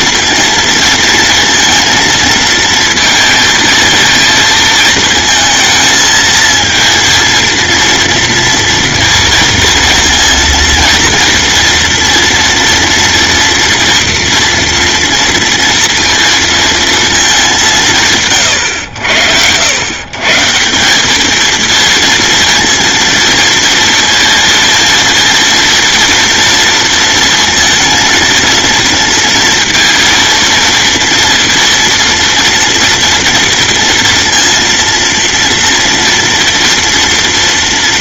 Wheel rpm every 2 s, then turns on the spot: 230, 220, 220, 230, 230, 230, 230, 230, 230, 100, 180, 230, 230, 230, 230, 230, 230, 230, 230.
none